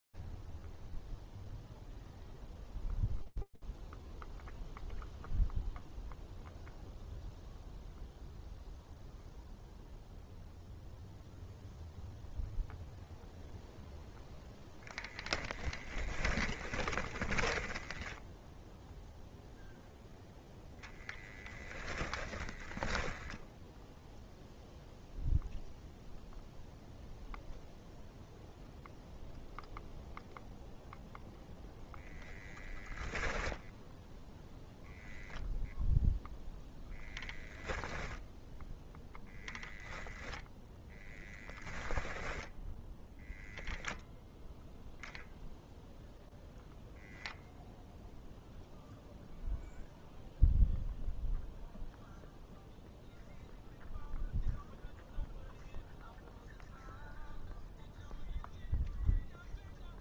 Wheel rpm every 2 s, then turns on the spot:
0, 0, 0, 0, 0, 0, 0, 10, 10, 0, 10, 0, 0, 0, 0, 10, 0, 0, 0, 0, 10, 0, 0, 0, 0, 0, 0, 0, 0, 0.
14-18 20-22 30-32